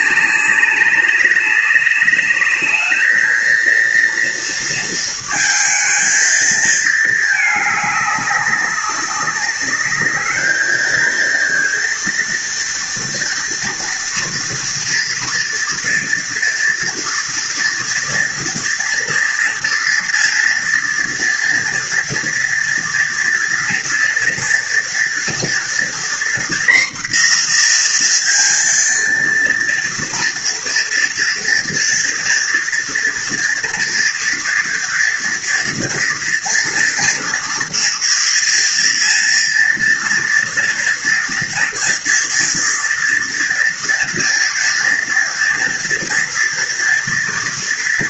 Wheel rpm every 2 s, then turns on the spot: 190, 220, 230, 220, 200, 220, 230, 230, 230, 230, 230, 230, 230, 240, 230, 240, 240, 230, 230, 230, 230, 230, 230, 230.
none